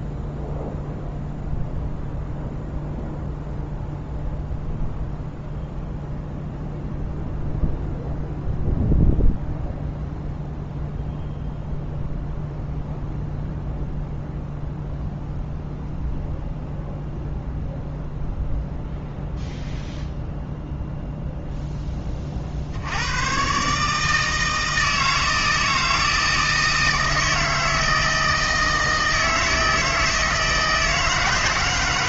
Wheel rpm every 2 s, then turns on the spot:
0, 0, 0, 0, 0, 0, 0, 0, 0, 0, 0, 70, 160, 160, 160, 160.
none